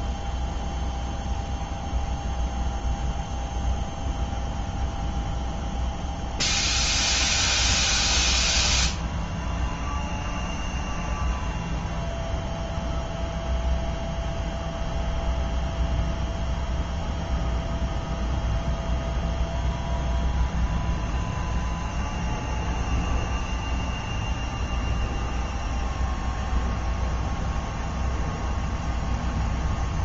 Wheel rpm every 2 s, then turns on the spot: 0, 0, 0, 0, 0, 0, 0, 0, 0, 0, 0, 0, 0, 0, 0.
none